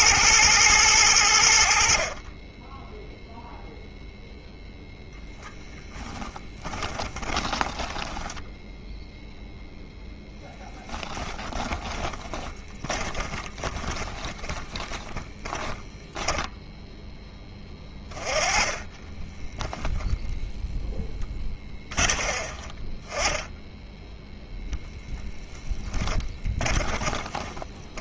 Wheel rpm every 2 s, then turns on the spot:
110, 20, 0, 20, 10, 10, 20, 20, 10, 20, 10, 20, 0, 20.
6-8 12-16 18-20 26-28